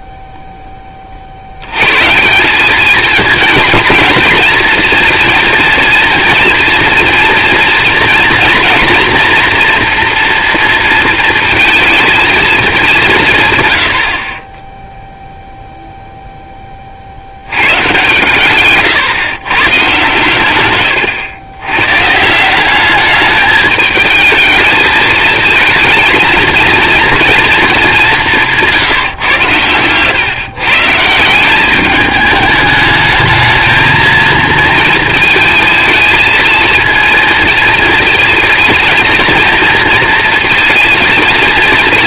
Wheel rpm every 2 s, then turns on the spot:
10, 200, 230, 230, 240, 230, 210, 10, 30, 130, 120, 190, 220, 230, 160, 140, 210, 220, 230, 230, 230.
18-20